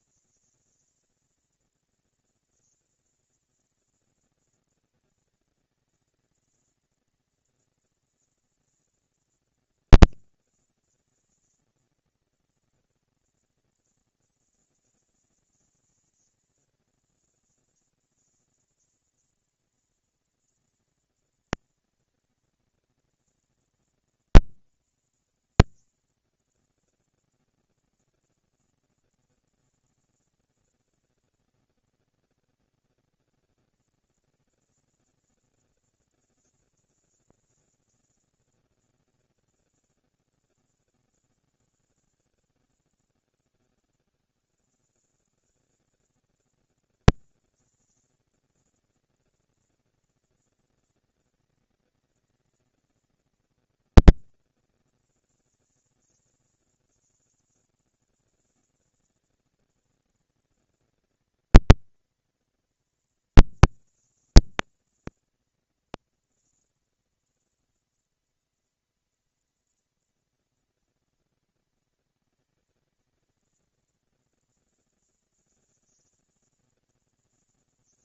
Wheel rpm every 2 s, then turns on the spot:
220, 230, 230, 230, 230, 230, 230, 230, 230, 230, 230, 220, 230, 230, 230, 230, 240, 230, 230, 230, 180, 130, 100, 200, 230, 230, 220, 220, 190, 190, 220, 230, 230, 230, 230, 230, 230, 230, 230.
none